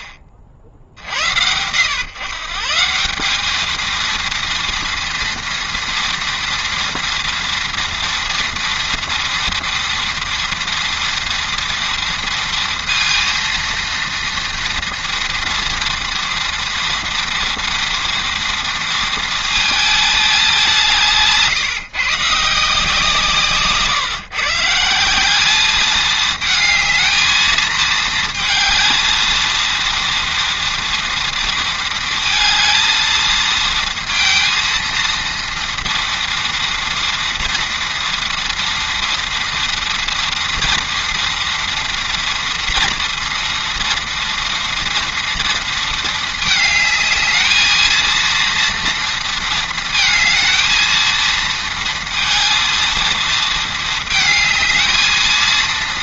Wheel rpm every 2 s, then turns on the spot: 70, 200, 230, 230, 230, 230, 230, 230, 230, 220, 150, 160, 190, 220, 230, 230, 230, 230, 230, 230, 230, 230, 230, 220, 230, 230, 220, 220.
20-22